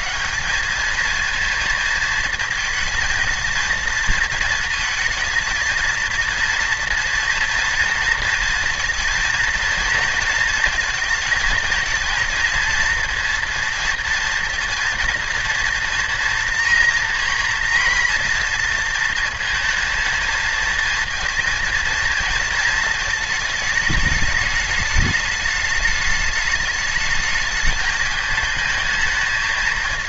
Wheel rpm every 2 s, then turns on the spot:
210, 220, 220, 230, 230, 230, 230, 230, 230, 230, 230, 220, 210, 210, 220.
none